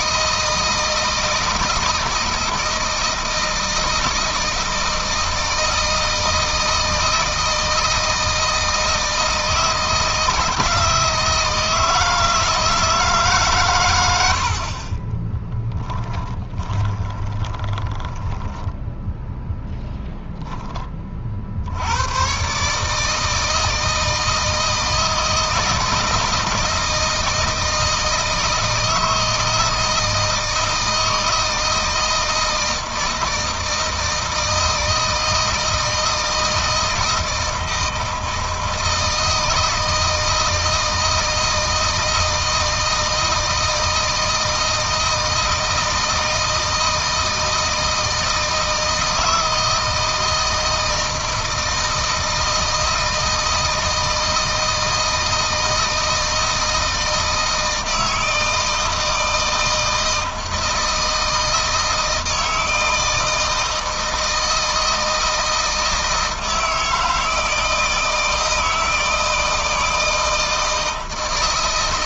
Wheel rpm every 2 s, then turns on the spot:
160, 160, 160, 160, 160, 160, 160, 50, 10, 10, 20, 140, 160, 160, 160, 160, 160, 160, 160, 160, 160, 160, 160, 160, 160, 160, 160, 160, 160, 160, 160, 160, 160, 160, 160, 160.
16-20